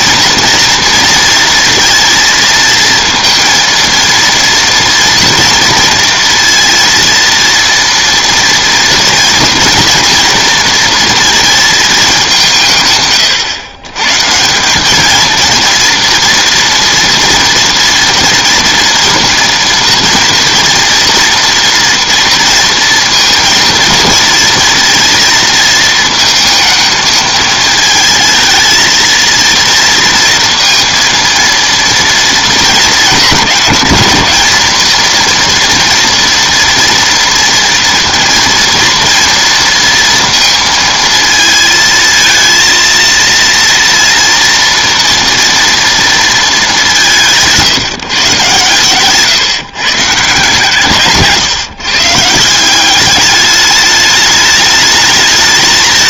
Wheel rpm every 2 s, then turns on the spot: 230, 230, 230, 230, 240, 240, 140, 190, 230, 230, 240, 230, 230, 220, 220, 230, 220, 220, 240, 230, 230, 230, 230, 200, 130, 150, 180, 210.
none